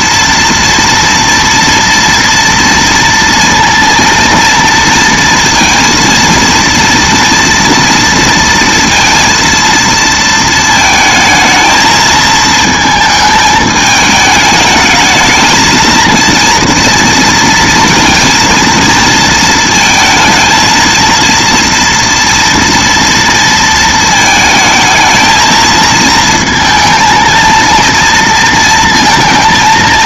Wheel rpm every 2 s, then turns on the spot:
230, 230, 230, 230, 230, 220, 220, 220, 230, 230, 230, 230, 220, 230, 230.
none